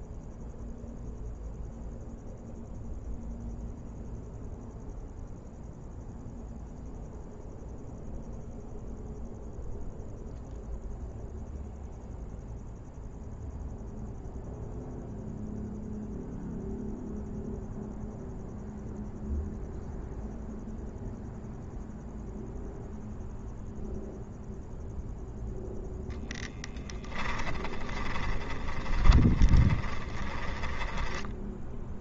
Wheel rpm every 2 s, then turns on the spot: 0, 0, 0, 0, 0, 0, 0, 0, 0, 0, 0, 0, 0, 10, 20, 10.
26-32